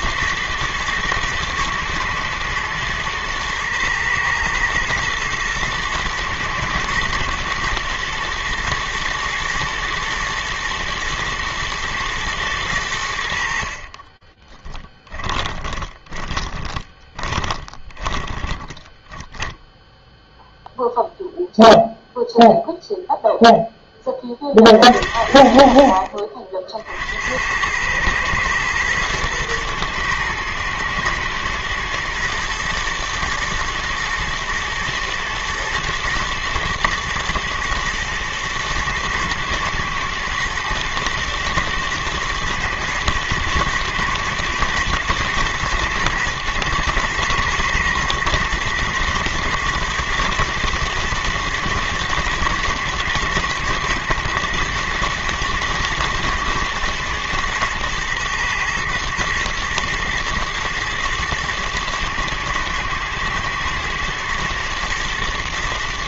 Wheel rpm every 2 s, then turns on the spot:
120, 120, 110, 110, 120, 110, 100, 20, 20, 20, 0, 0, 40, 50, 110, 110, 120, 110, 120, 120, 110, 110, 110, 110, 110, 110, 120, 110, 110, 110, 120, 110, 110.
14-20